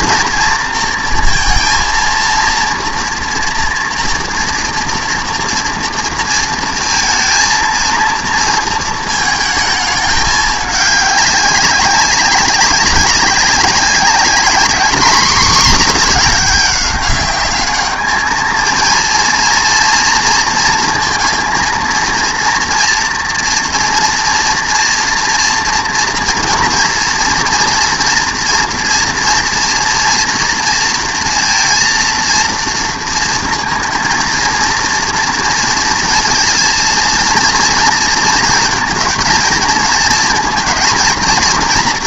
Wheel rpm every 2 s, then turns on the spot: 230, 230, 230, 230, 230, 210, 200, 220, 210, 230, 230, 230, 230, 240, 230, 230, 230, 230, 230, 230, 230.
none